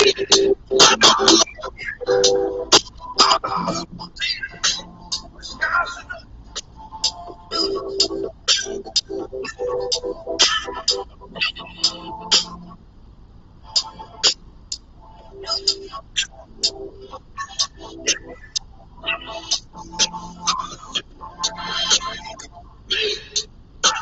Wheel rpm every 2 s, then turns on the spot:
0, 0, 0, 0, 0, 0, 0, 0, 0, 0, 0, 0.
none